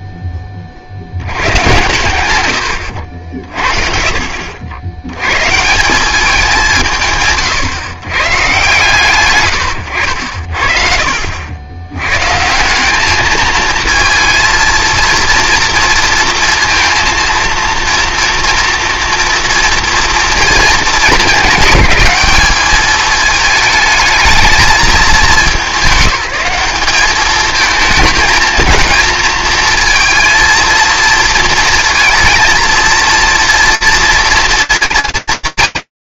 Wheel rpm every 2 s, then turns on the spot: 30, 90, 60, 180, 130, 50, 190, 230, 230, 230, 230, 210, 210, 200, 230, 230, 230, 230.
2-4 10-12